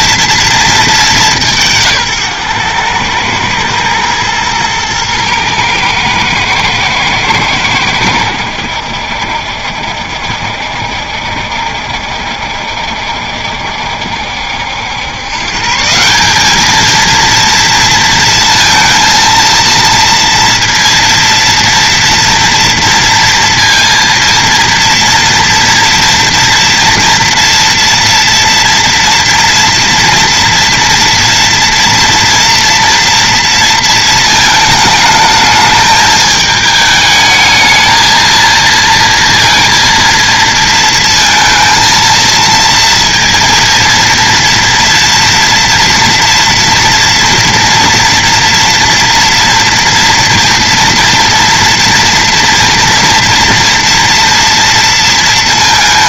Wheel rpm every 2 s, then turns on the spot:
210, 110, 110, 110, 80, 70, 70, 80, 220, 230, 230, 230, 230, 230, 240, 230, 230, 220, 220, 230, 230, 230, 230, 240, 240, 230, 230, 230.
none